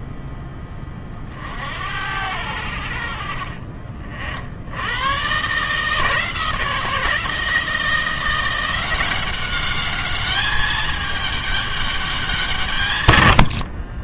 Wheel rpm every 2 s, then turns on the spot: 20, 70, 110, 160, 180, 210, 120.
none